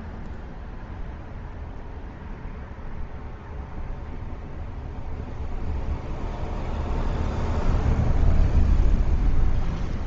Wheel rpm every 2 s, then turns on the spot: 0, 0, 0, 0, 0.
none